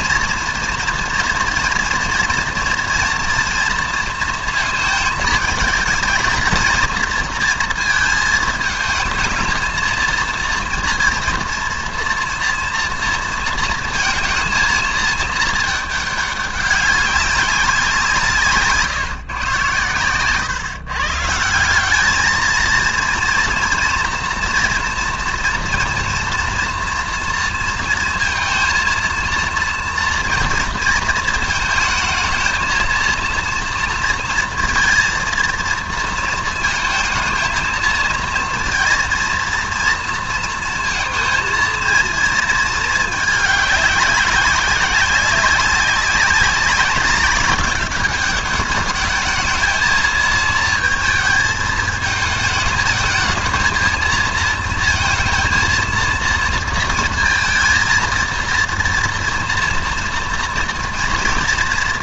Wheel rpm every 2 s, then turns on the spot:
230, 230, 230, 230, 230, 230, 230, 230, 200, 140, 140, 230, 230, 230, 230, 230, 230, 230, 230, 230, 230, 220, 190, 200, 210, 220, 220, 220, 230, 230, 230.
none